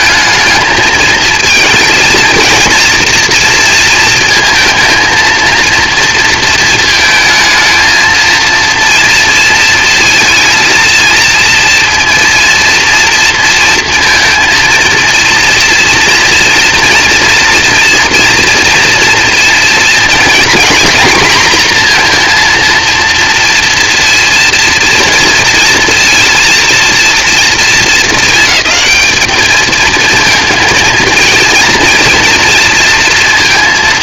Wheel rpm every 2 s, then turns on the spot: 220, 230, 230, 230, 230, 230, 230, 230, 230, 240, 240, 240, 230, 230, 220, 230, 230.
none